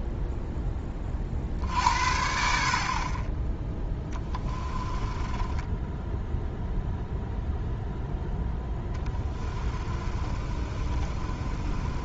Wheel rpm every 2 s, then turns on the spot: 20, 50, 20, 0, 10, 30.
4-6 8-12